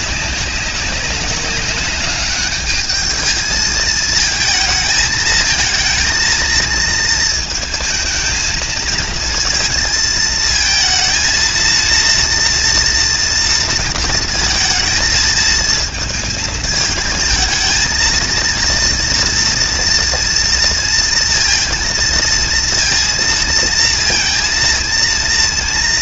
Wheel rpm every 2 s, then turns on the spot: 190, 210, 220, 230, 220, 220, 230, 220, 220, 230, 230, 230, 230.
none